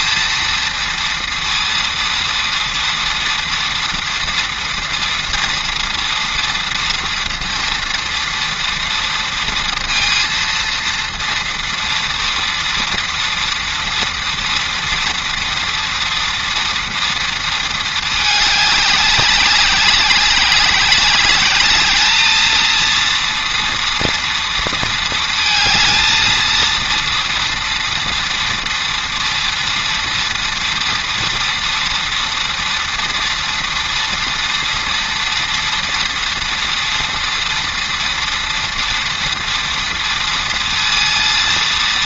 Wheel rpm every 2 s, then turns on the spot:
230, 230, 230, 230, 230, 230, 230, 230, 240, 200, 200, 230, 230, 230, 230, 230, 230, 230, 230, 230, 230.
none